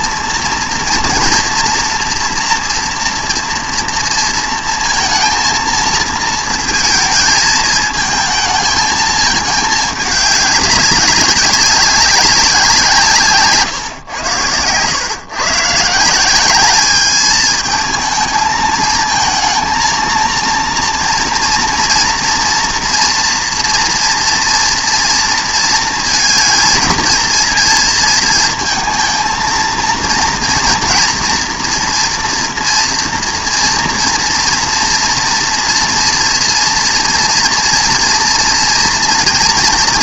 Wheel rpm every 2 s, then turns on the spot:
230, 230, 230, 230, 220, 200, 180, 110, 200, 220, 230, 240, 230, 220, 220, 230, 230, 230, 230, 230.
none